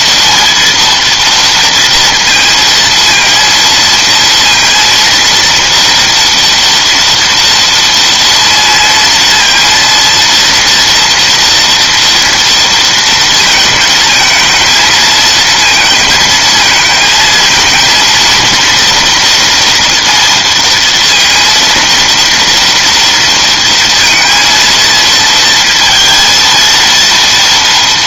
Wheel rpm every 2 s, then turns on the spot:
230, 230, 230, 230, 230, 230, 230, 220, 220, 230, 230, 230, 230, 230.
none